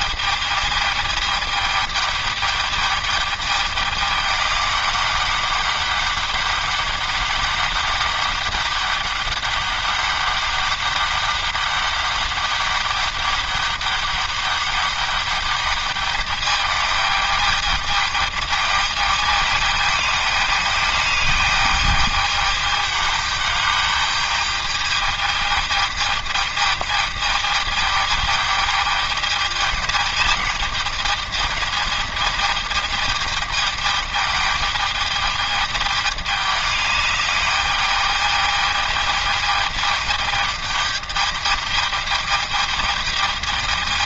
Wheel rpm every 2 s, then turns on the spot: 210, 210, 200, 200, 200, 200, 200, 200, 210, 210, 210, 210, 210, 210, 210, 210, 210, 210, 210, 210, 210, 210.
none